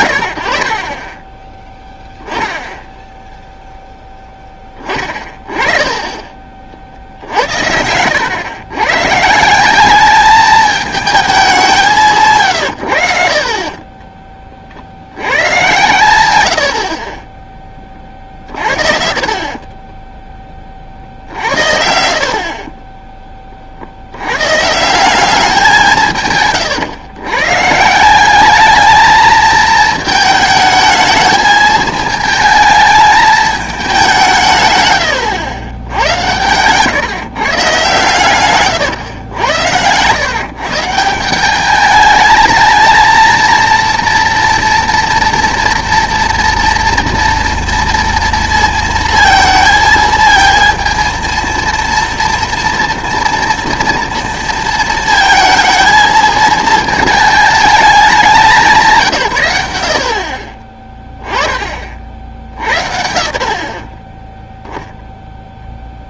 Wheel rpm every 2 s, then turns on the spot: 80, 10, 20, 40, 120, 210, 130, 40, 80, 40, 30, 40, 140, 140, 210, 220, 220, 130, 130, 120, 150, 220, 230, 230, 230, 230, 230, 230, 220, 190, 30, 80, 0.
18-20 22-24